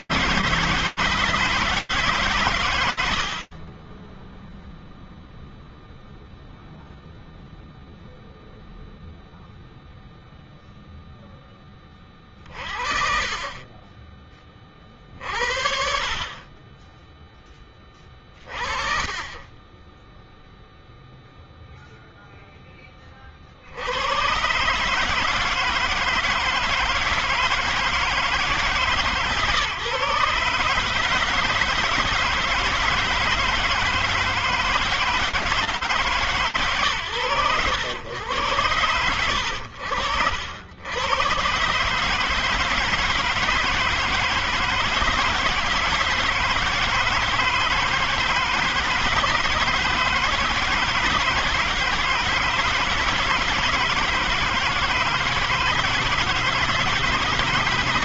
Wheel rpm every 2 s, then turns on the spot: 160, 110, 0, 0, 0, 20, 20, 50, 20, 20, 0, 60, 160, 160, 140, 160, 160, 160, 110, 90, 130, 160, 160, 160, 160, 160, 160, 160, 160.
none